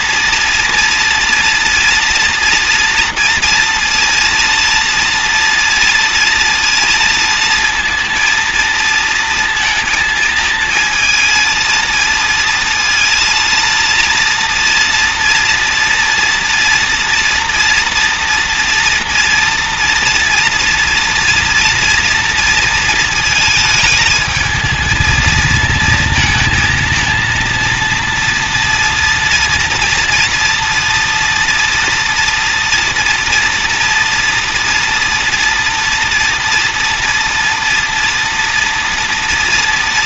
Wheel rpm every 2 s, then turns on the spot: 240, 230, 230, 230, 230, 220, 230, 230, 230, 230, 230, 230, 220, 230, 230, 230, 230, 230, 230, 230.
none